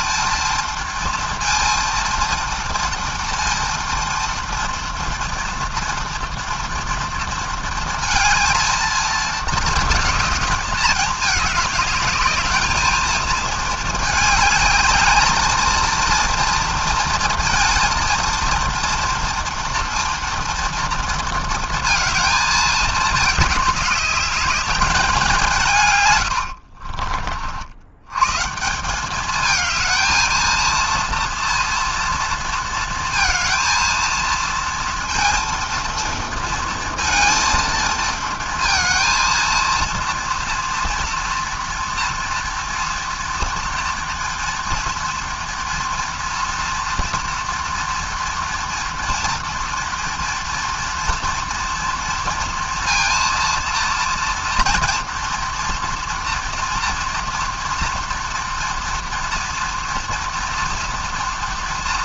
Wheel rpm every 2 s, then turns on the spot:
230, 230, 230, 230, 230, 210, 210, 210, 230, 230, 230, 220, 200, 80, 170, 230, 230, 230, 230, 230, 230, 230, 240, 230, 230, 230, 230, 230, 240, 230, 230.
26-28